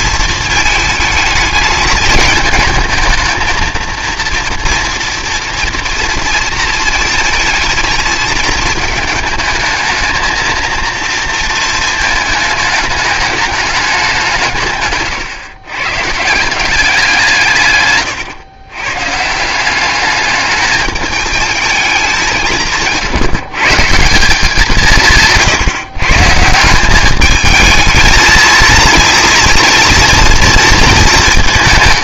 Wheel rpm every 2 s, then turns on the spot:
220, 220, 230, 230, 220, 230, 220, 150, 170, 120, 210, 160, 180, 170, 230, 230.
none